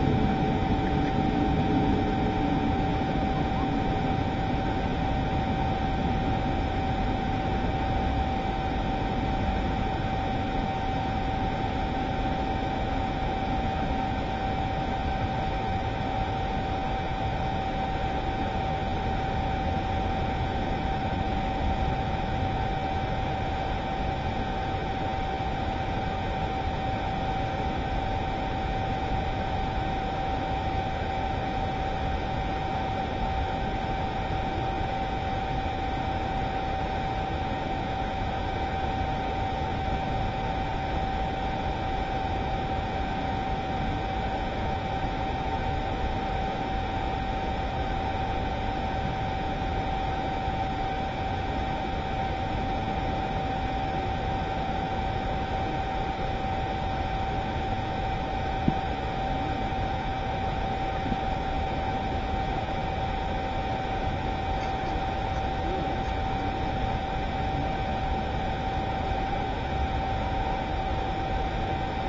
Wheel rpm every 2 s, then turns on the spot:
0, 0, 0, 0, 0, 0, 0, 0, 0, 0, 0, 0, 0, 0, 0, 0, 0, 0, 0, 0, 0, 0, 0, 0, 0, 0, 0, 0, 0, 0, 0, 0, 0, 0, 0, 0.
none